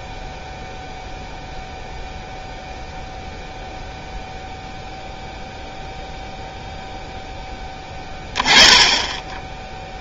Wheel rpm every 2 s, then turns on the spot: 0, 0, 0, 0, 20.
8-10